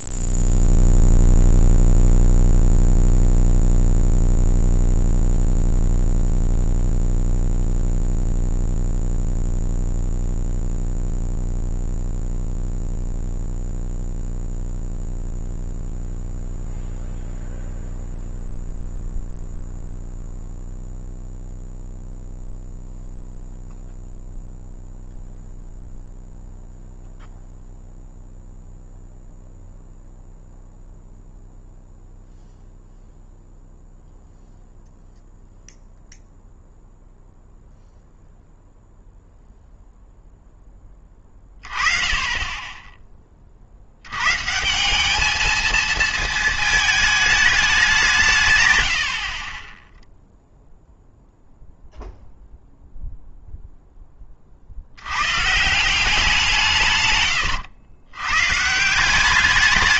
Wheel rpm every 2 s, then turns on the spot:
0, 0, 0, 0, 0, 0, 0, 0, 0, 0, 0, 0, 0, 0, 0, 0, 0, 0, 0, 0, 10, 20, 160, 220, 110, 0, 0, 50, 160, 140.
none